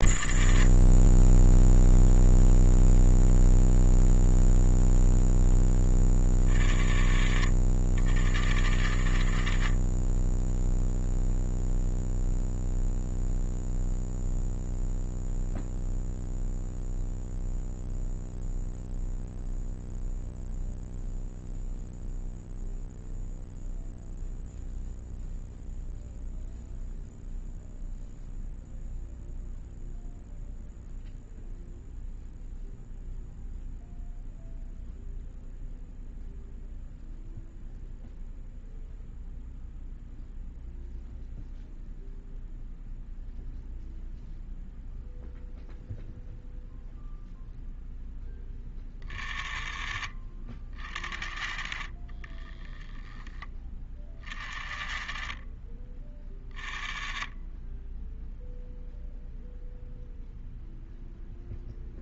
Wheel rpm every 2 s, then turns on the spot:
40, 0, 0, 30, 60, 0, 0, 0, 0, 0, 0, 0, 0, 0, 0, 0, 0, 0, 0, 0, 0, 0, 0, 0, 20, 40, 10, 40, 30, 0, 0.
none